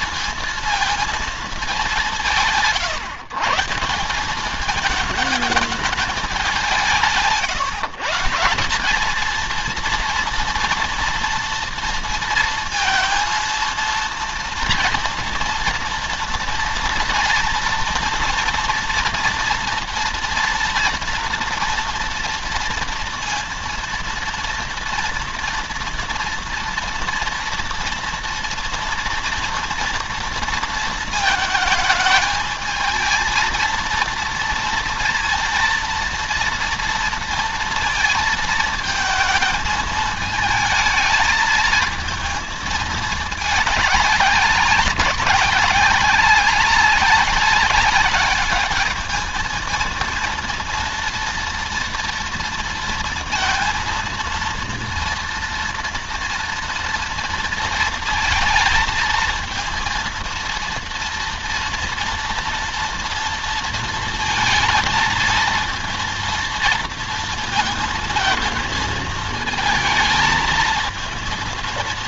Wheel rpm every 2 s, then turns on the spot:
220, 160, 200, 180, 200, 230, 230, 230, 230, 230, 240, 240, 230, 230, 230, 230, 220, 230, 230, 220, 220, 220, 200, 190, 210, 230, 230, 230, 230, 230, 230, 230, 220, 230, 220, 230.
none